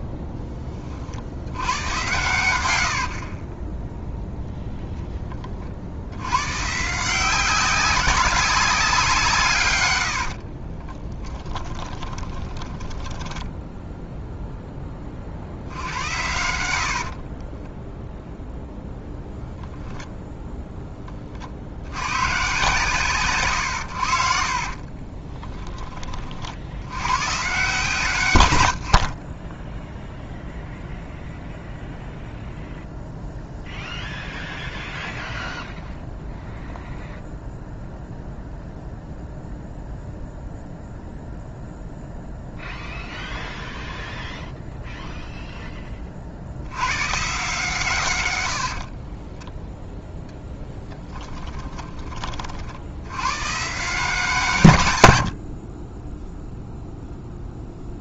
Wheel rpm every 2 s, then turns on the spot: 20, 90, 0, 130, 190, 40, 10, 10, 80, 0, 10, 140, 40, 70, 100, 0, 0, 0, 0, 0, 0, 0, 0, 90, 70, 10, 50, 150, 0.
2-4 10-14 16-18 24-26 48-52